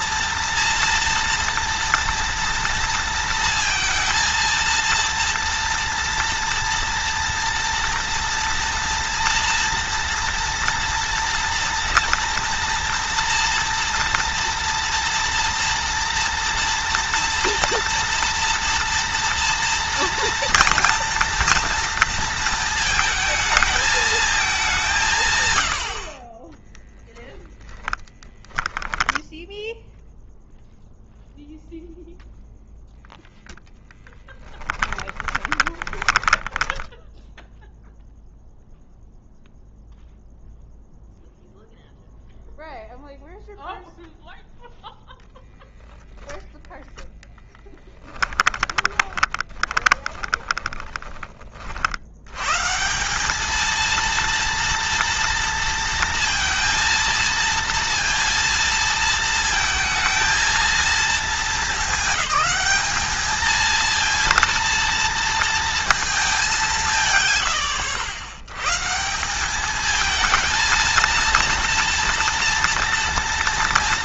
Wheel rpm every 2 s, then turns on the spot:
230, 230, 230, 230, 240, 230, 230, 230, 230, 230, 230, 220, 170, 20, 10, 0, 0, 10, 10, 0, 0, 0, 0, 0, 20, 20, 170, 230, 230, 230, 230, 210, 230, 160, 140, 230, 230.
26-28 34-38 48-52